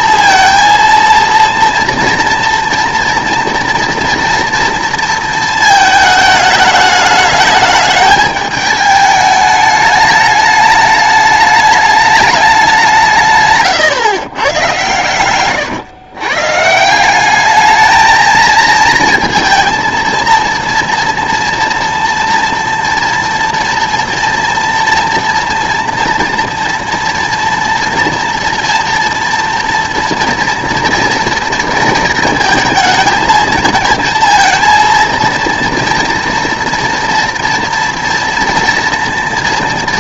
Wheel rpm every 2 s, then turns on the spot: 230, 230, 230, 210, 210, 210, 200, 120, 140, 230, 230, 230, 230, 230, 230, 230, 220, 220, 230, 230.
none